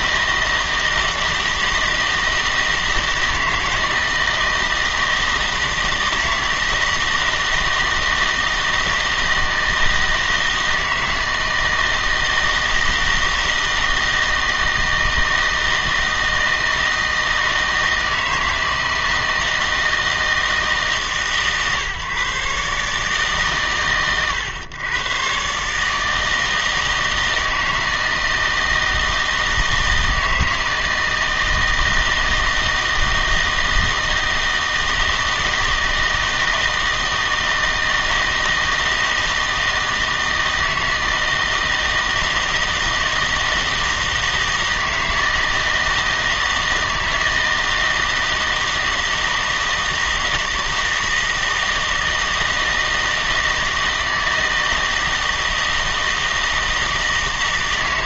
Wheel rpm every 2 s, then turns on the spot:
160, 160, 160, 160, 160, 160, 160, 160, 160, 160, 160, 140, 120, 160, 160, 160, 160, 160, 160, 160, 160, 160, 160, 160, 160, 160, 160, 160, 160.
none